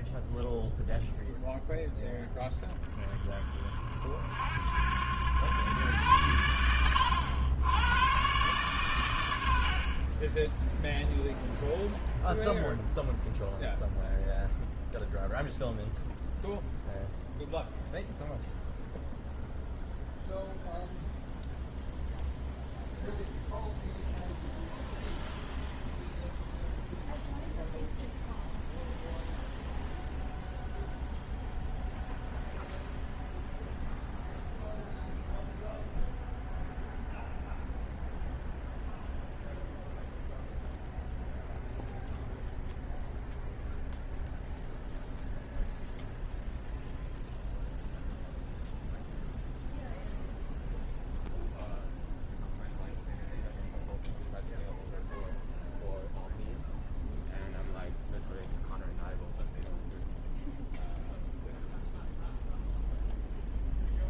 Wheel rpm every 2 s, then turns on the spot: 0, 20, 90, 90, 110, 0, 0, 0, 0, 0, 0, 0, 0, 0, 0, 0, 0, 0, 0, 0, 0, 0, 0, 0, 0, 0, 0, 0, 0, 0, 0, 0.
none